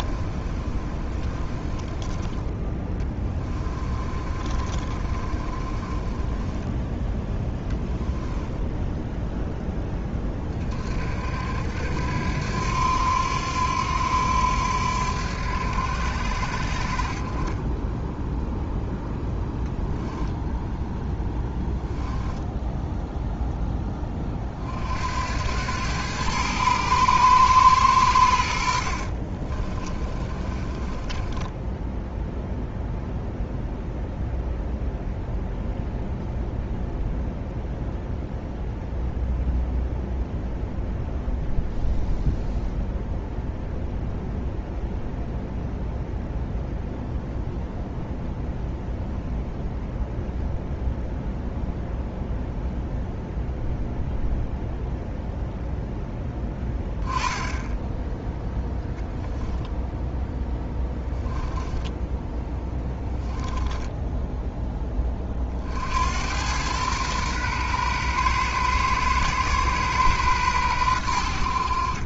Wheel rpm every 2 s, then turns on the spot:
30, 20, 30, 10, 10, 30, 80, 90, 80, 0, 0, 0, 30, 110, 80, 20, 0, 0, 0, 0, 0, 0, 0, 0, 0, 0, 0, 0, 10, 0, 10, 10, 10, 90, 120, 120.
0-2 4-10 30-32 62-64